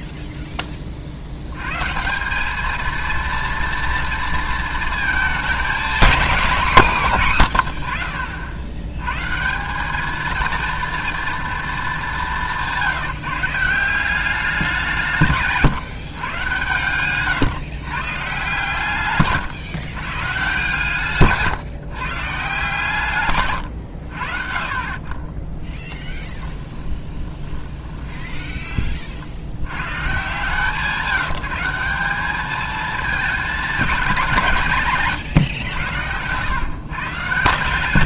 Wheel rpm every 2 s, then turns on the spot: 20, 220, 230, 200, 90, 230, 170, 180, 120, 140, 140, 140, 40, 20, 30, 160, 210, 150, 130.
26-28